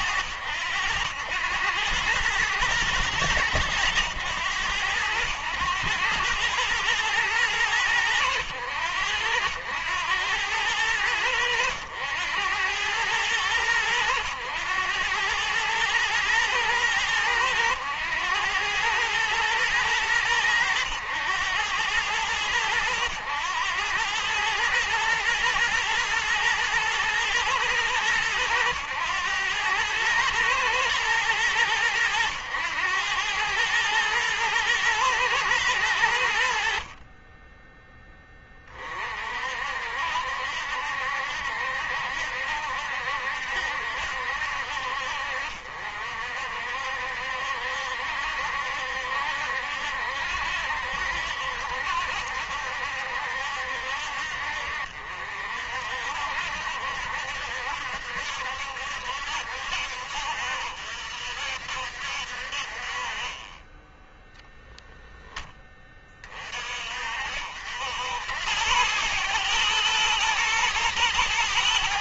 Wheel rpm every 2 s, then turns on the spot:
90, 110, 100, 110, 90, 100, 100, 100, 110, 110, 100, 100, 110, 110, 100, 110, 100, 110, 50, 40, 70, 70, 60, 60, 70, 70, 70, 60, 70, 70, 60, 40, 0, 40, 100, 120.
none